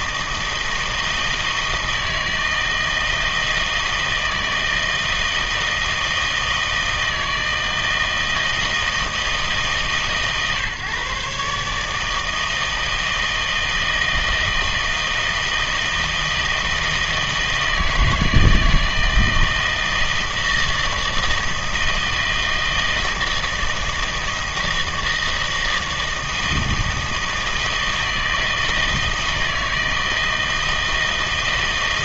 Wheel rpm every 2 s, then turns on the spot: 160, 160, 160, 160, 160, 140, 160, 160, 160, 160, 160, 160, 160, 160, 160, 160.
none